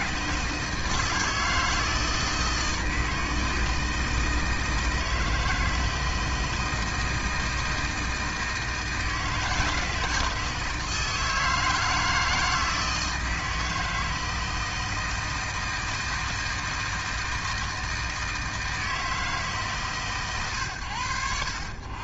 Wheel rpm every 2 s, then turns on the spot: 160, 160, 160, 160, 160, 160, 160, 160, 160, 160, 110.
none